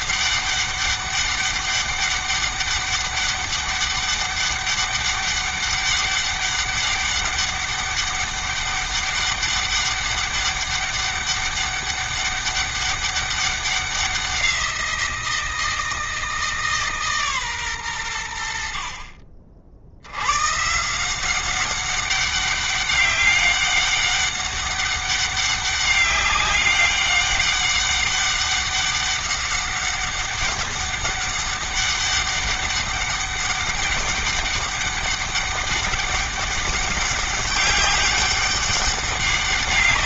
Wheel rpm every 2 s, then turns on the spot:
200, 200, 200, 200, 200, 200, 200, 180, 160, 80, 120, 200, 200, 200, 200, 200, 200, 200, 190, 200.
none